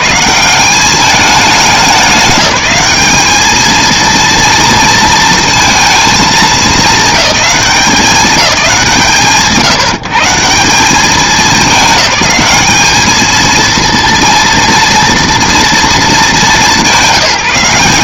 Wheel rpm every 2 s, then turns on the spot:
180, 210, 230, 220, 190, 170, 210, 230, 200.
none